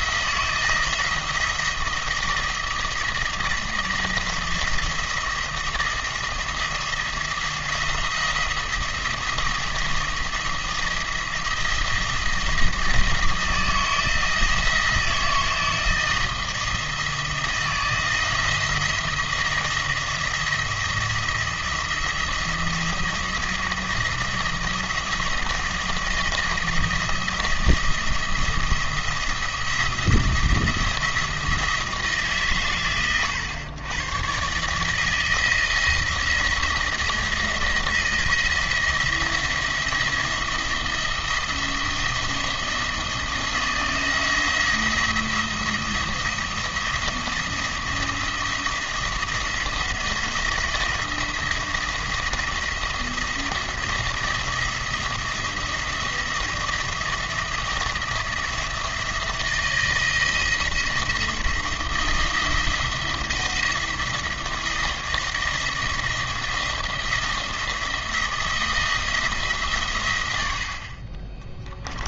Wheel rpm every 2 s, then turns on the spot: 160, 170, 170, 170, 170, 170, 170, 160, 170, 170, 170, 170, 170, 170, 170, 170, 120, 150, 170, 170, 170, 170, 170, 170, 170, 170, 170, 170, 170, 170, 170, 170, 170, 160, 160, 60.
none